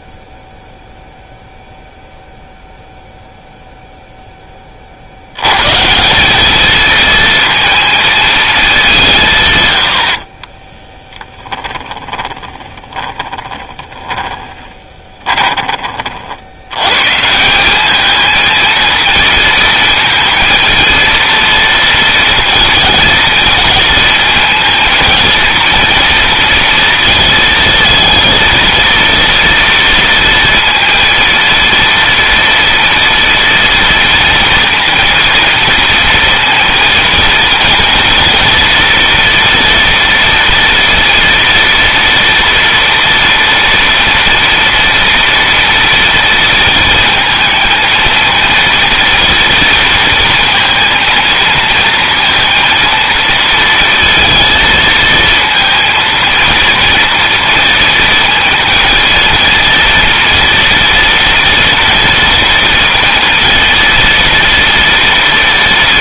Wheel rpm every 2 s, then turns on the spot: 0, 0, 30, 220, 200, 30, 20, 20, 110, 230, 230, 230, 230, 230, 230, 230, 230, 230, 230, 230, 230, 230, 230, 230, 230, 230, 230, 230, 230, 230, 230, 230, 230.
10-16